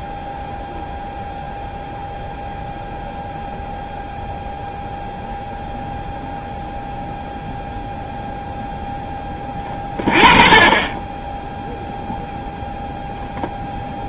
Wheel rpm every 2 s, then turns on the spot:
0, 0, 0, 0, 0, 20, 0.
none